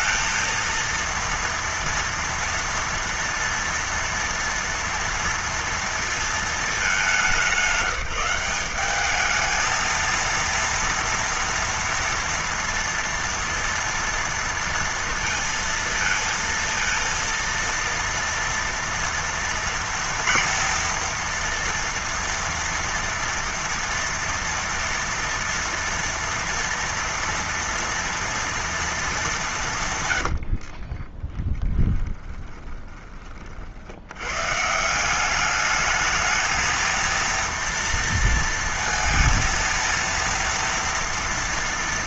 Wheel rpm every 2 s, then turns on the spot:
230, 230, 230, 200, 200, 230, 230, 230, 230, 230, 230, 230, 230, 230, 230, 50, 20, 140, 220, 230, 230.
30-34